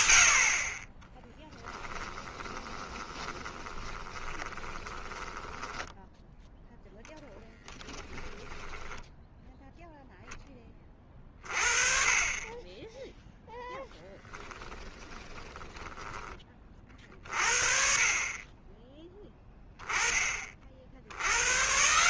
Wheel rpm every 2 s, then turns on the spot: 30, 20, 20, 0, 10, 20, 10, 20, 30, 20, 50.
2-6 14-16